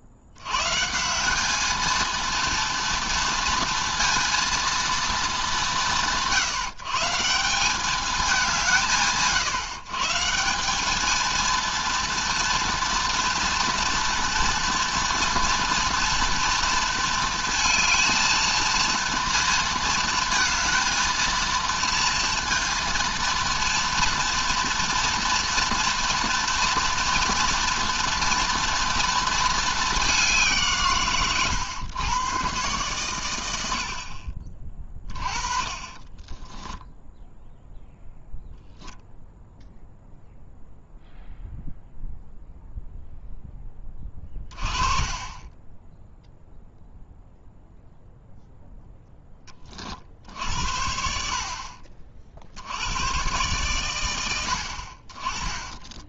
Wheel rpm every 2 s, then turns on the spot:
70, 230, 220, 130, 130, 180, 230, 230, 230, 230, 220, 230, 230, 230, 230, 150, 120, 30, 10, 0, 0, 0, 20, 0, 0, 60, 80, 60.
none